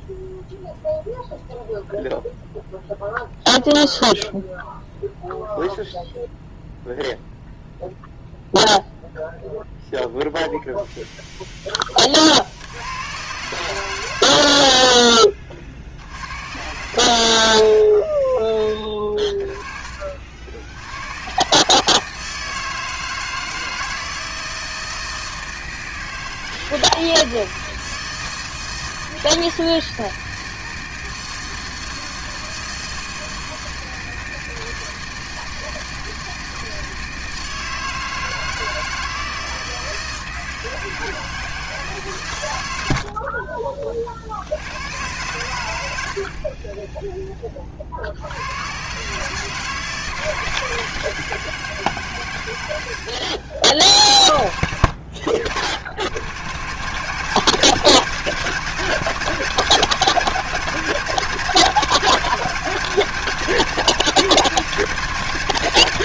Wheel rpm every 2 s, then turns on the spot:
0, 0, 0, 0, 0, 0, 70, 60, 100, 20, 80, 160, 160, 160, 160, 160, 160, 160, 160, 160, 160, 100, 90, 30, 110, 160, 90, 70, 120, 170, 180, 170, 160.
none